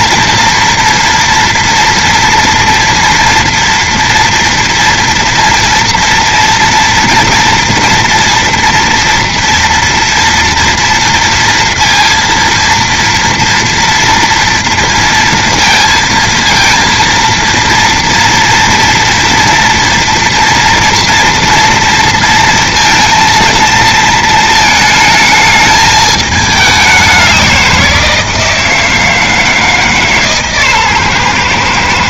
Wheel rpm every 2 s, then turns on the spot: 230, 230, 230, 230, 230, 240, 230, 230, 230, 230, 230, 230, 220, 200, 160, 140.
none